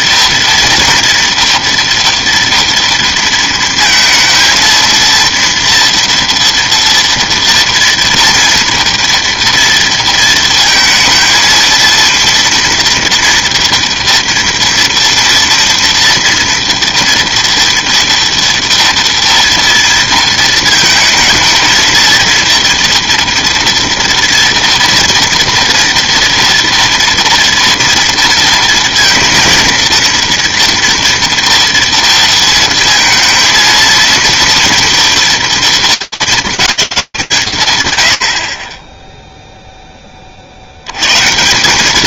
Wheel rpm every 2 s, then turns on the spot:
230, 230, 230, 230, 230, 230, 230, 230, 230, 230, 230, 230, 230, 230, 230, 230, 230, 230, 230, 90, 40.
none